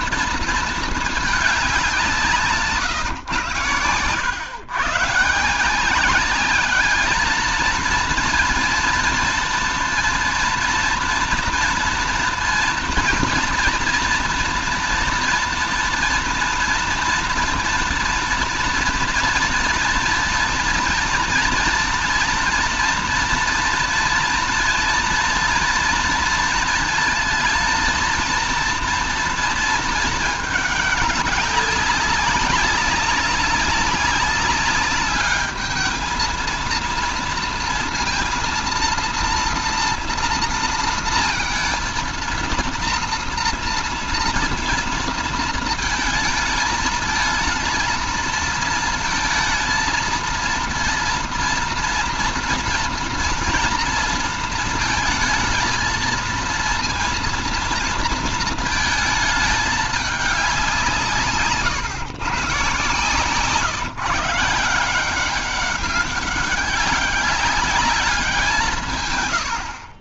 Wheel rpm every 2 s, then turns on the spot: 230, 140, 120, 200, 230, 230, 230, 230, 230, 230, 230, 230, 240, 230, 230, 220, 200, 200, 230, 230, 230, 230, 230, 220, 230, 230, 230, 230, 230, 230, 200, 160, 150, 200, 170.
none